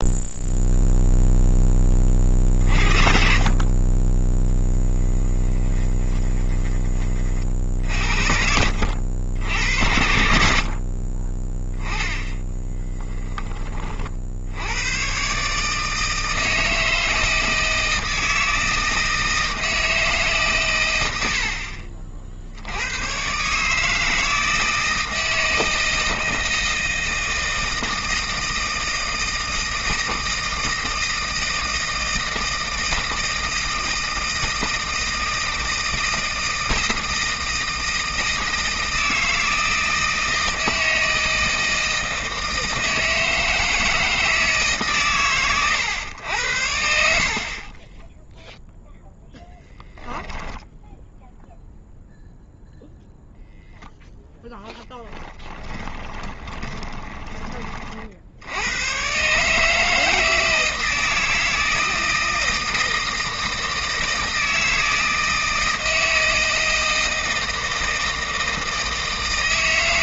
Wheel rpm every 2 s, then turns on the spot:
0, 40, 10, 20, 70, 40, 10, 100, 160, 160, 120, 90, 160, 160, 160, 160, 160, 160, 160, 160, 160, 160, 140, 60, 0, 0, 0, 10, 20, 110, 160, 160, 160, 160, 160.
12-14 56-58